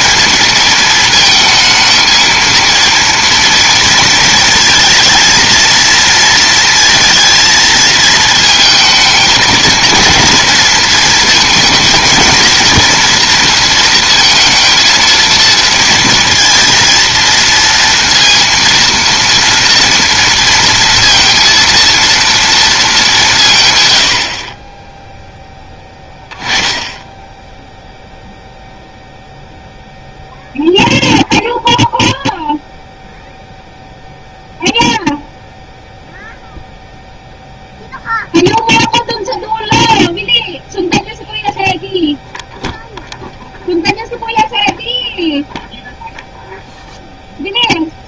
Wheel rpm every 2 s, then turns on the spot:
220, 230, 220, 230, 220, 230, 230, 230, 230, 230, 230, 220, 40, 10, 0, 0, 0, 0, 0, 0, 0, 0, 0, 0.
none